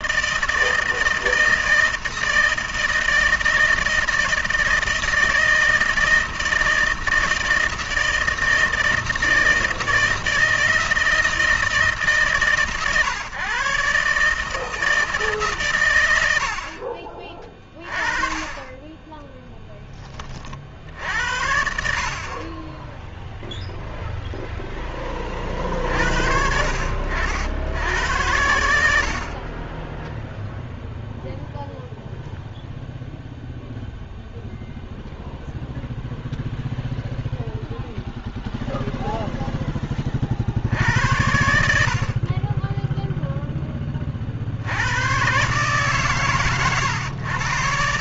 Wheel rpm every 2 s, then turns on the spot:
160, 160, 160, 160, 160, 160, 130, 150, 70, 20, 50, 20, 0, 70, 90, 0, 0, 0, 0, 0, 60, 20, 60, 120.
none